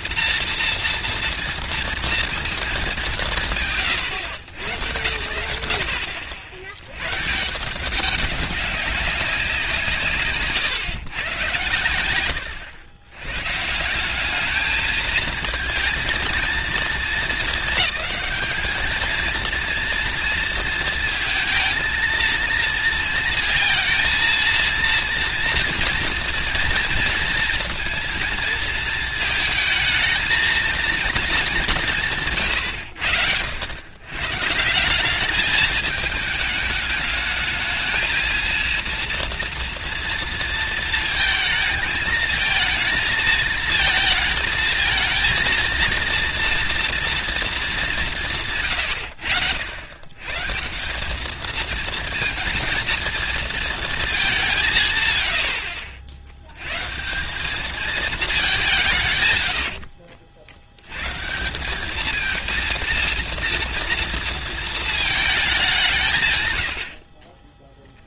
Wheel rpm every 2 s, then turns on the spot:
230, 230, 110, 30, 200, 130, 80, 210, 220, 220, 230, 230, 230, 230, 220, 230, 120, 130, 220, 230, 230, 220, 220, 240, 150, 150, 230, 190, 90, 200, 70, 220, 230, 110.
none